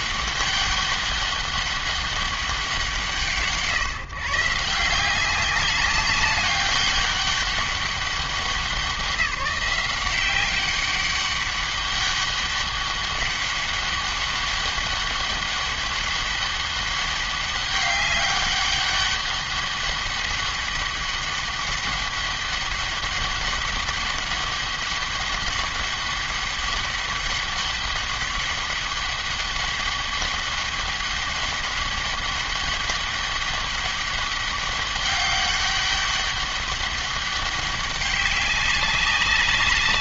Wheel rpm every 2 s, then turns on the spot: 200, 180, 160, 200, 190, 200, 200, 200, 200, 200, 200, 200, 200, 200, 200, 200, 200, 200, 200, 190.
none